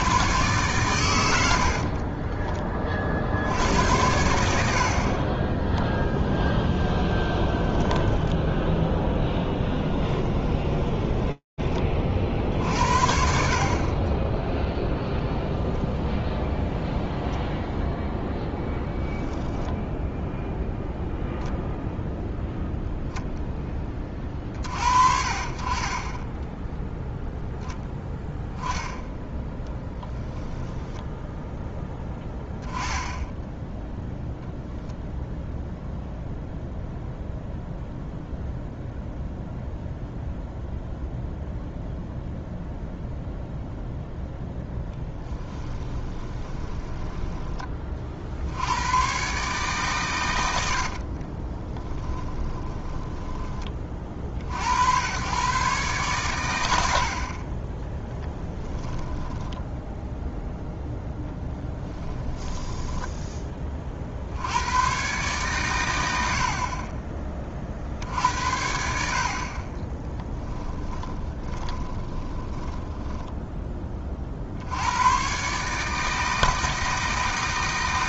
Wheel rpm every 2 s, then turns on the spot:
120, 30, 50, 20, 10, 10, 60, 10, 0, 10, 0, 0, 50, 0, 10, 10, 10, 0, 0, 0, 0, 0, 0, 10, 110, 60, 10, 90, 70, 10, 0, 10, 110, 30, 60, 10, 20, 80, 160.
6-12 46-48 50-54 58-60 62-64 70-74